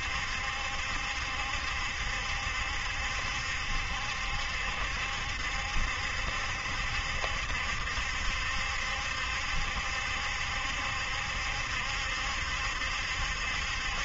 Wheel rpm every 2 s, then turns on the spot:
70, 70, 70, 70, 70, 70, 70.
none